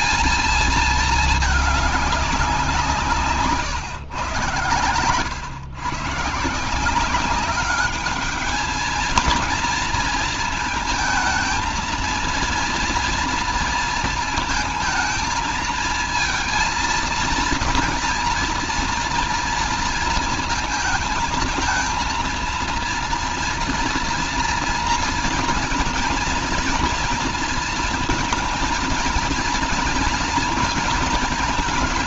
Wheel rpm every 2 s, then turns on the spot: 220, 180, 110, 170, 220, 230, 230, 220, 230, 230, 220, 230, 230, 230, 230, 230.
none